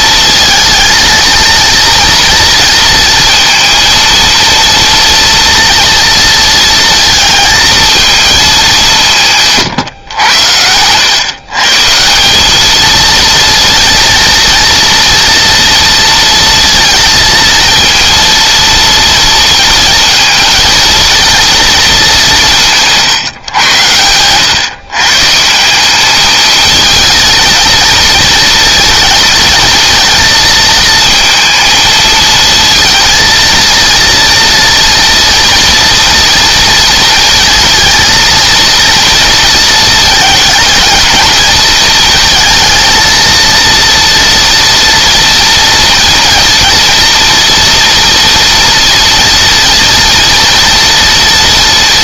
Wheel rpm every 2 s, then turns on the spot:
230, 230, 230, 230, 180, 110, 230, 230, 230, 230, 220, 160, 150, 210, 230, 230, 230, 230, 230, 230, 220, 230, 230, 230, 230, 230.
none